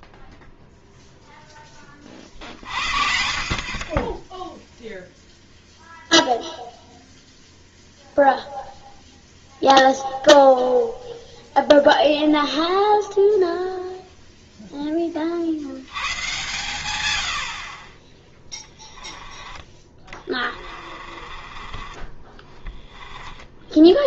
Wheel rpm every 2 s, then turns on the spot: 0, 60, 0, 0, 0, 0, 0, 10, 110, 20, 30, 20.
20-24